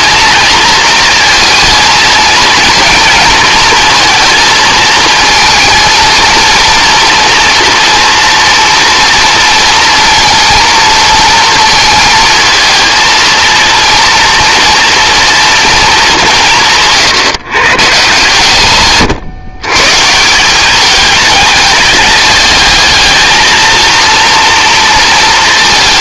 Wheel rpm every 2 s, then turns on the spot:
230, 230, 230, 230, 230, 230, 230, 230, 160, 140, 200, 210, 230.
none